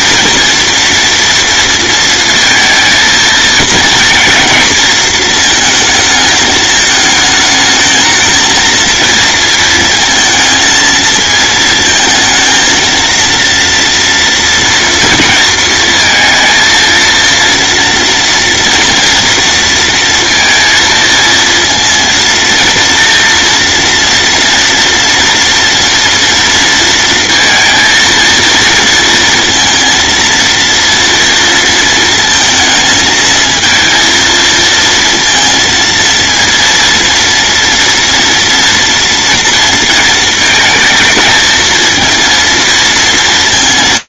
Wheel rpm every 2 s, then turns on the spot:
230, 230, 230, 210, 230, 220, 230, 230, 230, 230, 230, 230, 230, 230, 230, 230, 220, 230, 230, 230, 230, 220.
none